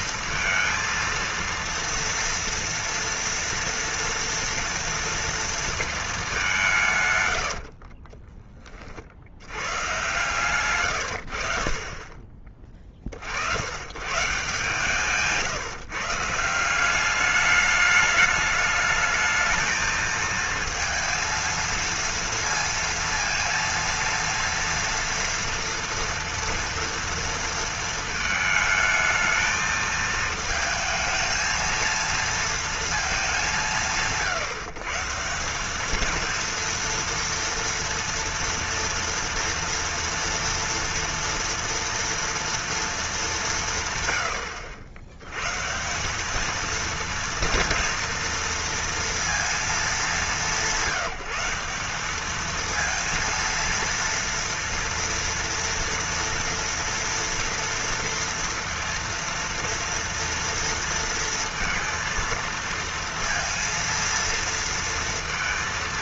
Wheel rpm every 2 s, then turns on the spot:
230, 230, 230, 160, 30, 120, 30, 150, 180, 210, 230, 230, 230, 230, 220, 220, 230, 160, 230, 230, 230, 230, 90, 220, 230, 170, 230, 230, 230, 230, 230, 230, 230.
10-12